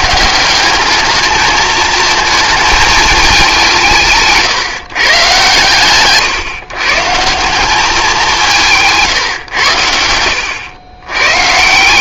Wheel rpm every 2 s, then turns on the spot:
190, 220, 150, 140, 170, 100.
none